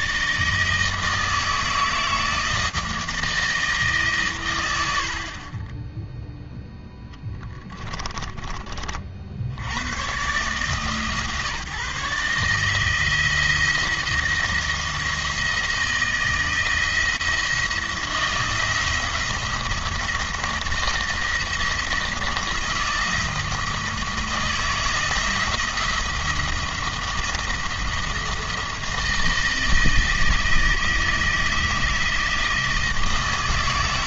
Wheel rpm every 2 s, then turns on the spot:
160, 160, 70, 10, 40, 140, 160, 160, 170, 170, 170, 170, 160, 170, 160, 160, 160.
4-8